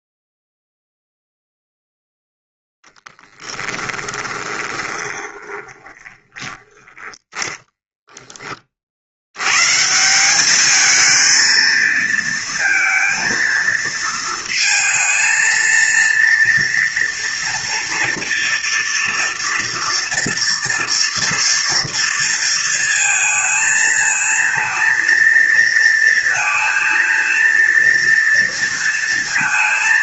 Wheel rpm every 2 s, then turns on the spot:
0, 10, 20, 20, 50, 220, 230, 230, 230, 230, 230, 230, 230, 230, 230.
4-8